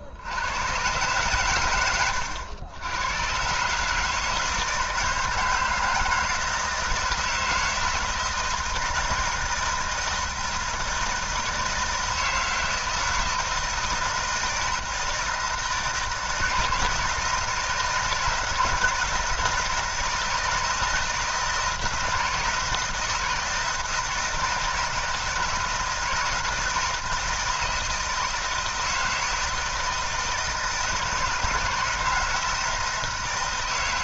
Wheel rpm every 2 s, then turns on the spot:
130, 100, 160, 160, 160, 160, 160, 160, 160, 170, 160, 160, 170, 160, 160, 160, 160.
none